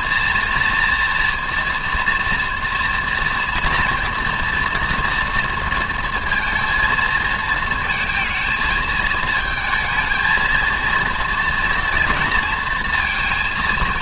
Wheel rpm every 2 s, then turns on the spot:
240, 230, 230, 220, 220, 230, 230.
none